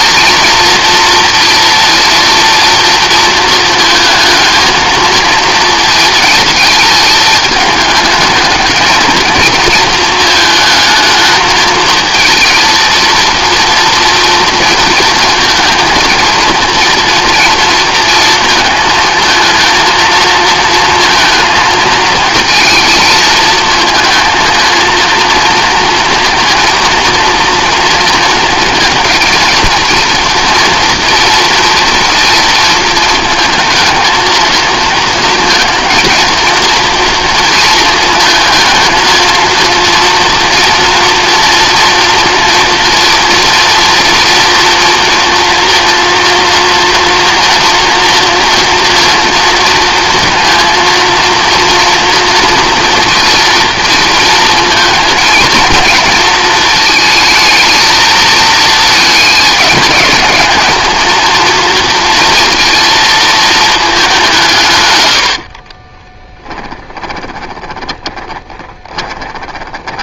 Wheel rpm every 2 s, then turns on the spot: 230, 230, 230, 220, 220, 220, 230, 240, 230, 230, 220, 220, 230, 230, 220, 230, 230, 230, 230, 230, 230, 230, 230, 230, 230, 230, 230, 230, 220, 230, 220, 230, 150, 10, 30.
66-70